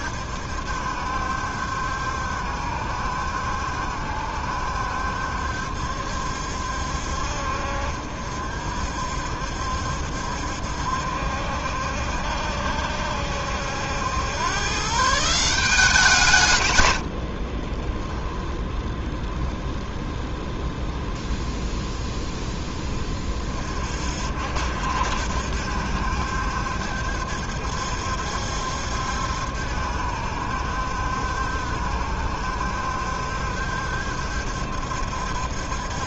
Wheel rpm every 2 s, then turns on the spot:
70, 70, 70, 60, 60, 70, 70, 140, 120, 10, 0, 10, 60, 70, 70, 70, 70, 70.
18-20